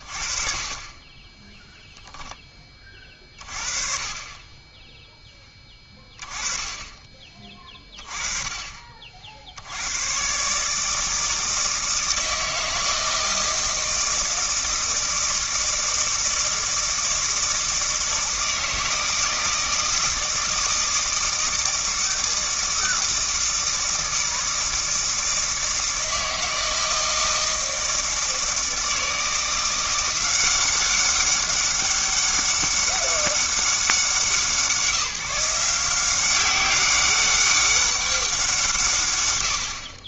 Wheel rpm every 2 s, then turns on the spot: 40, 10, 20, 20, 30, 140, 160, 160, 160, 160, 160, 160, 160, 160, 160, 180, 200, 170, 190, 170.
none